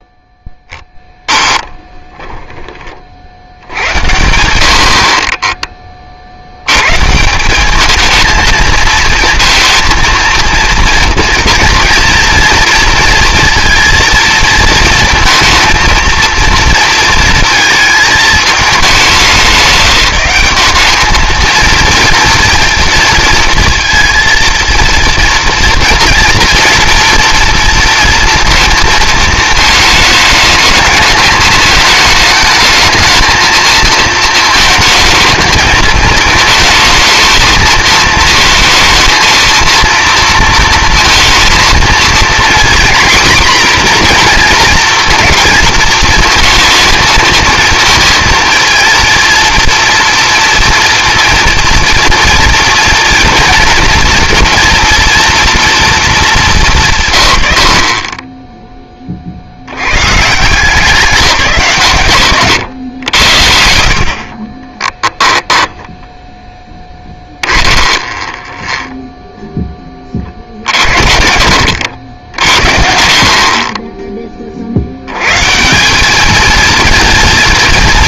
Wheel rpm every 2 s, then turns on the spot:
10, 20, 70, 90, 220, 230, 230, 230, 230, 210, 200, 230, 230, 230, 230, 220, 220, 220, 220, 220, 230, 240, 240, 230, 230, 230, 230, 240, 190, 10, 160, 120, 30, 10, 10, 50, 60, 40, 230.
2-4 64-68